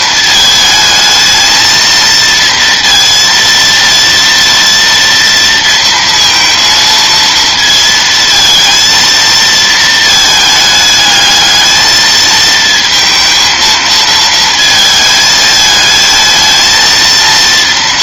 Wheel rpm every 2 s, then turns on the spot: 220, 230, 230, 230, 230, 210, 230, 220, 230.
none